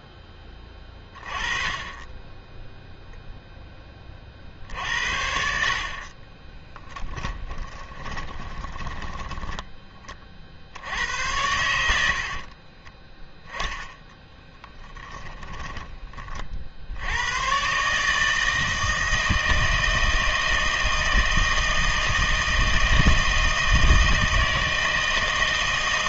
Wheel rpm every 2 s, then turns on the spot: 10, 0, 60, 10, 20, 60, 30, 10, 60, 160, 160, 160, 160.
6-10 12-16